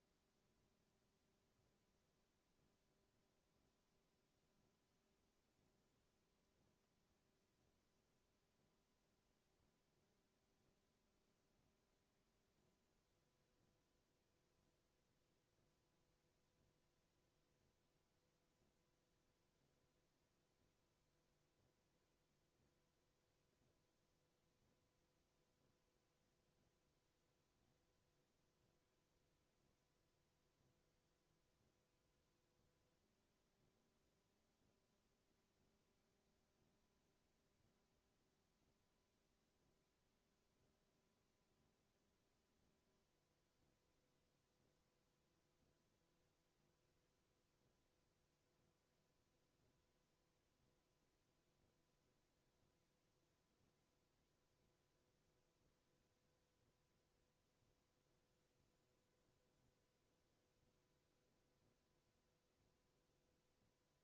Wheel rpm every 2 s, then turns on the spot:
0, 0, 0, 0, 0, 0, 0, 0, 0, 0, 0, 0, 0, 0, 0, 0, 0, 0, 0, 0, 0, 0, 0, 0, 0, 0, 0, 0, 0, 0, 0, 0.
none